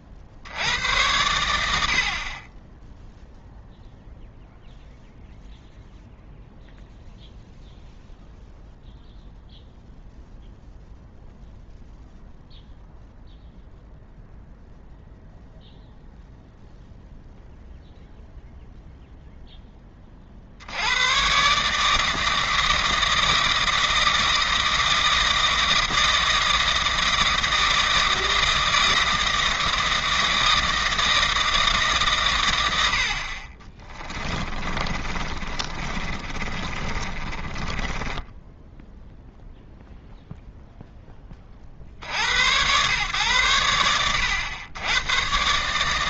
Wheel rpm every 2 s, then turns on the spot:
60, 10, 0, 0, 0, 0, 0, 0, 0, 0, 80, 160, 160, 160, 160, 160, 90, 20, 30, 0, 0, 100, 90.
34-38